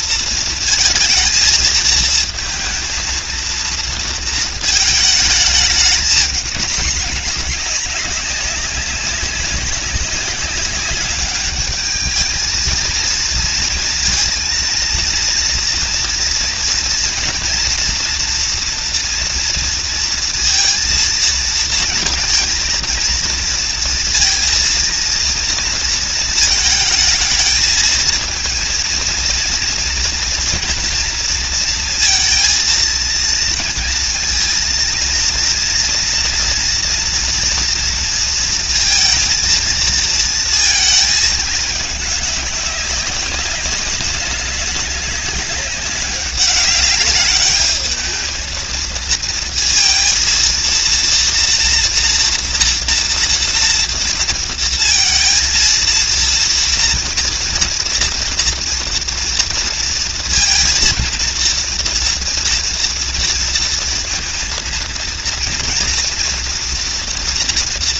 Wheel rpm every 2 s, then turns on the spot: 230, 230, 230, 210, 190, 200, 220, 230, 230, 230, 230, 230, 230, 220, 230, 230, 230, 230, 230, 230, 220, 200, 190, 200, 220, 230, 230, 230, 240, 240, 230, 230, 230, 230.
none